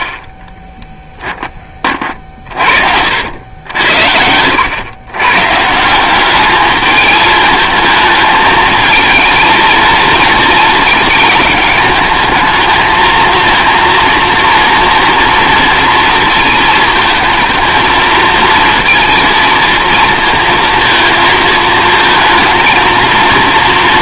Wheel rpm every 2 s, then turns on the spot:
10, 50, 100, 210, 220, 220, 220, 230, 230, 230, 230, 230.
0-2